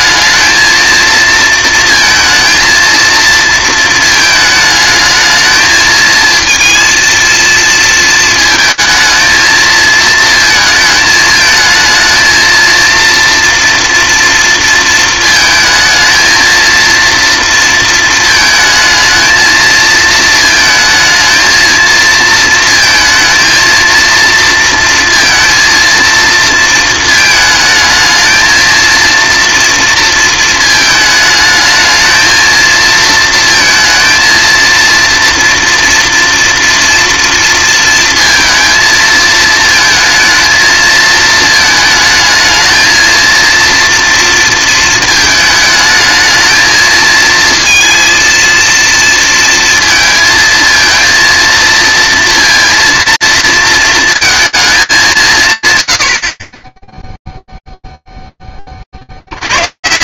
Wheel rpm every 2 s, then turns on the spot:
220, 220, 220, 230, 220, 220, 230, 230, 230, 220, 220, 230, 230, 220, 220, 220, 220, 230, 230, 230, 220, 220, 230, 220, 230, 220, 230, 210, 10, 0.
none